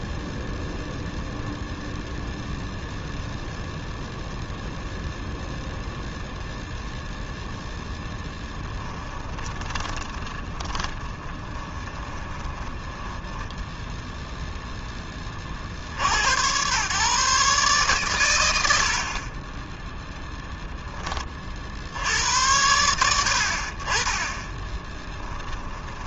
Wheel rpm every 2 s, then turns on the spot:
0, 0, 0, 0, 10, 20, 20, 10, 120, 80, 0, 90, 10.
8-14